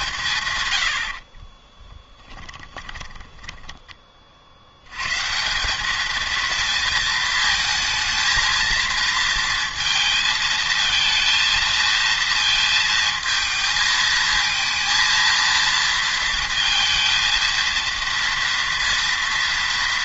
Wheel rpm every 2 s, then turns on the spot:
70, 20, 110, 220, 230, 220, 230, 230, 220, 230.
2-4